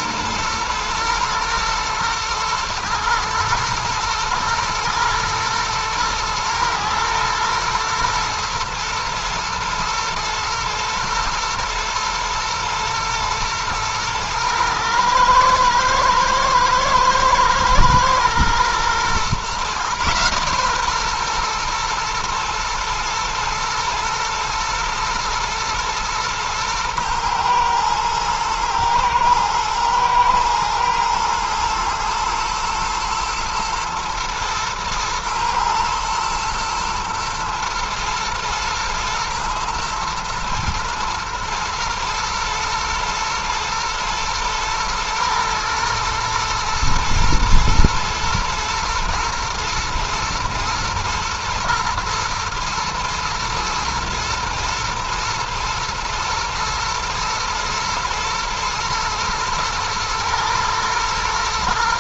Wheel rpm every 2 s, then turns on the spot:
120, 110, 110, 110, 110, 110, 110, 110, 110, 120, 130, 110, 110, 110, 110, 110, 110, 120, 120, 120, 110, 120, 110, 110, 120, 120, 110, 110, 110, 120, 110.
none